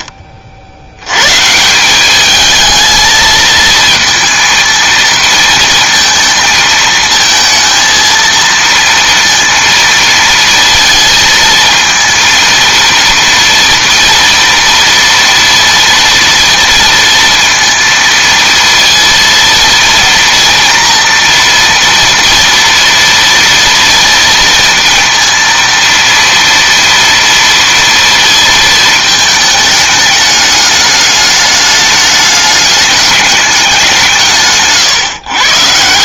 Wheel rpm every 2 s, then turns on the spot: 30, 210, 230, 220, 230, 230, 230, 230, 230, 230, 230, 230, 230, 230, 230, 210, 210, 160.
none